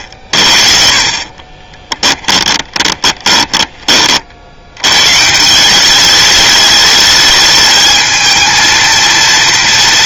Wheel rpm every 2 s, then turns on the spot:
40, 20, 110, 210, 230.
2-4